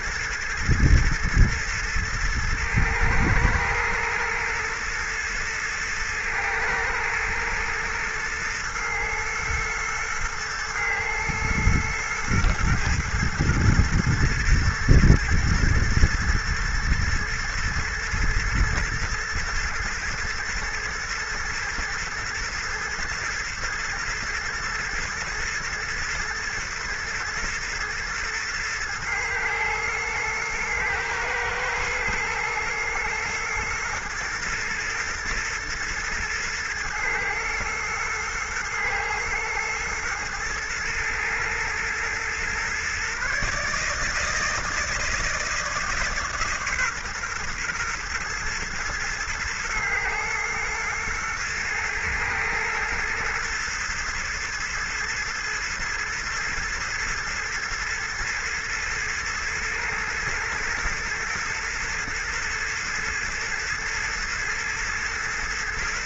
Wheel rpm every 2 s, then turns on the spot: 120, 110, 120, 120, 110, 120, 120, 110, 110, 110, 120, 120, 110, 120, 120, 110, 120, 120, 110, 110, 110, 120, 160, 140, 120, 120, 110, 110, 120, 120, 110, 120, 120.
none